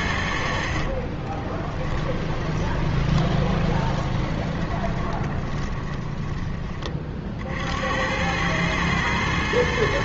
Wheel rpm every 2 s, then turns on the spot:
70, 20, 20, 20, 110.
2-6